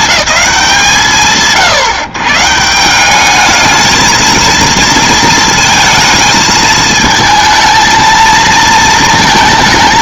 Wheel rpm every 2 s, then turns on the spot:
180, 140, 230, 220, 220.
none